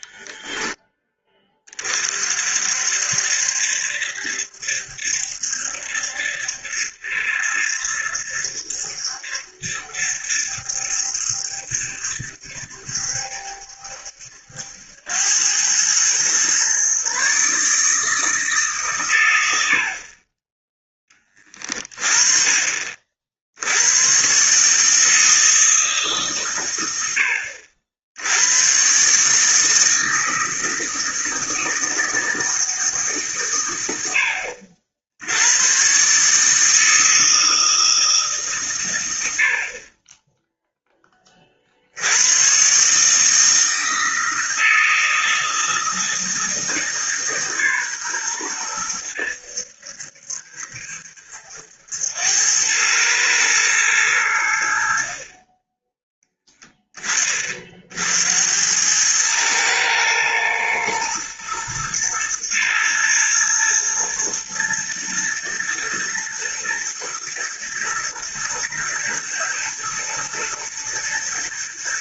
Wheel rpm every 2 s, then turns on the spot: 10, 60, 70, 70, 70, 70, 70, 80, 130, 140, 10, 40, 150, 110, 120, 160, 160, 70, 160, 110, 10, 130, 160, 160, 100, 70, 100, 60, 20, 100, 110, 110, 110, 110, 110, 110.
none